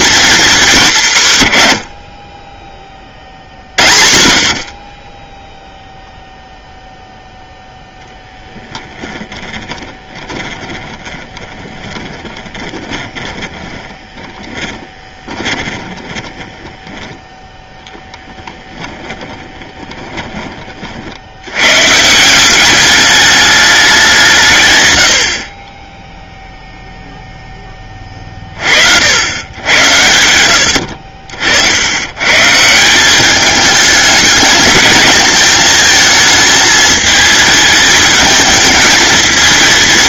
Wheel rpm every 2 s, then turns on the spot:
200, 10, 50, 0, 20, 20, 20, 20, 10, 20, 50, 200, 120, 0, 50, 80, 160, 220, 220, 220.
8-20